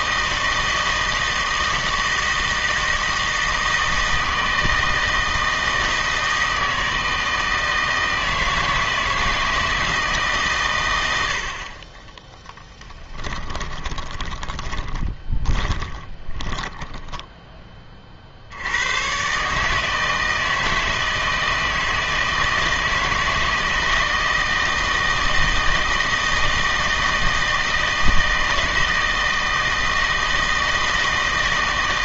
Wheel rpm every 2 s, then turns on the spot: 160, 160, 160, 160, 160, 120, 10, 20, 10, 100, 160, 160, 160, 160, 160, 160.
12-16